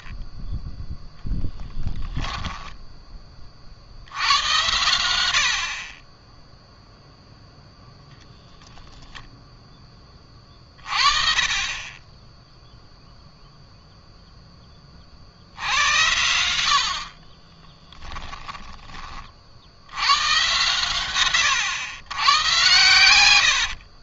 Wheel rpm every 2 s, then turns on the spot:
10, 10, 110, 0, 0, 30, 0, 30, 60, 20, 110, 110.
2-4